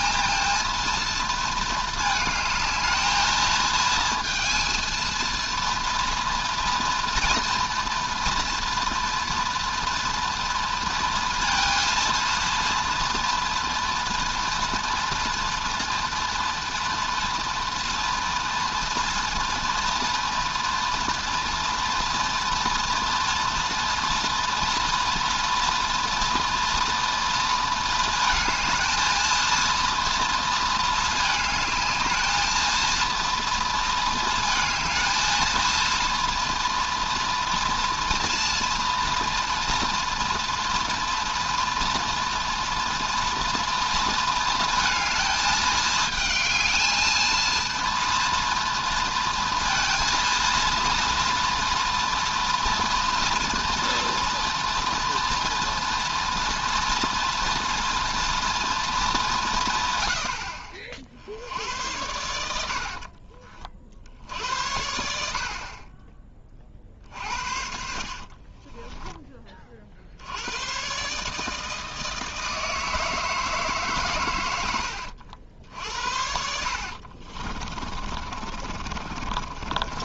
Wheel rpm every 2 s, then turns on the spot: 230, 220, 230, 230, 230, 230, 230, 240, 240, 230, 240, 230, 230, 230, 220, 220, 220, 220, 230, 240, 230, 230, 220, 220, 230, 230, 230, 230, 240, 230, 60, 60, 70, 50, 20, 120, 160, 100, 70, 50.
62-66 68-70 76-80